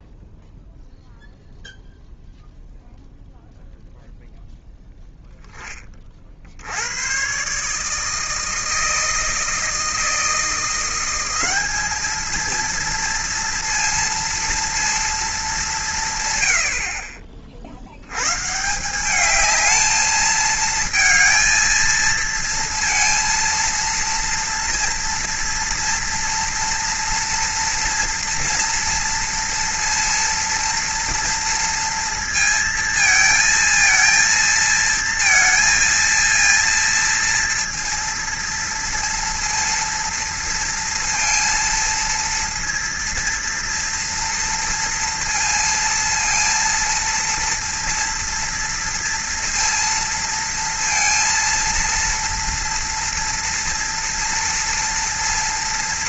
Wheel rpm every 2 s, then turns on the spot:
0, 0, 0, 80, 160, 170, 230, 230, 70, 170, 230, 230, 230, 230, 230, 230, 220, 230, 230, 230, 230, 230, 230, 230, 230, 230, 230, 230.
none